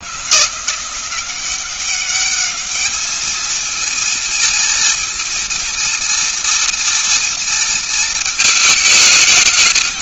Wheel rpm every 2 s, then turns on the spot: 170, 210, 230, 230, 220.
none